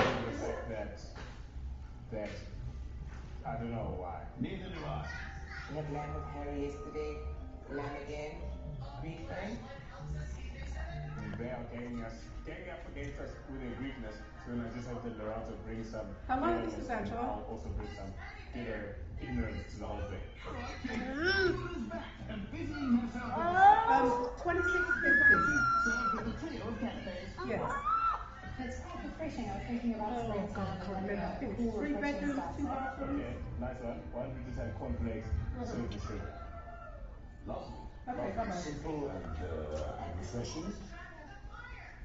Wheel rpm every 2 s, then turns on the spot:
0, 0, 0, 0, 0, 0, 0, 0, 0, 0, 0, 0, 0, 0, 0, 0, 0, 0, 0, 0, 0.
none